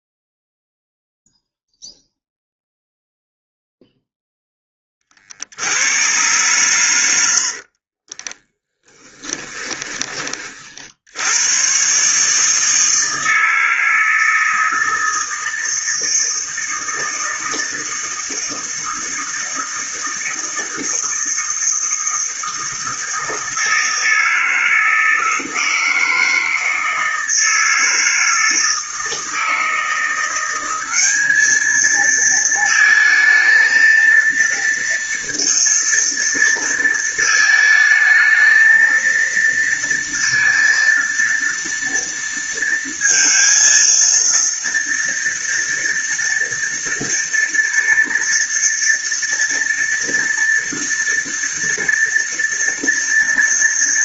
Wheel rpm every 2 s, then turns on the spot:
0, 0, 10, 120, 20, 40, 150, 160, 160, 160, 160, 160, 160, 160, 160, 180, 230, 230, 230, 220, 230, 230, 230, 230, 230, 230, 230.
8-10